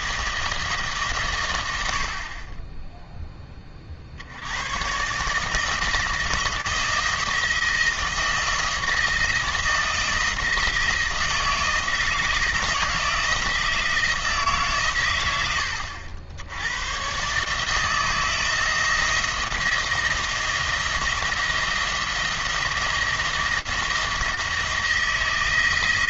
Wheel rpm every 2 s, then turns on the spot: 150, 10, 120, 160, 170, 170, 160, 130, 100, 160, 170, 170, 170.
none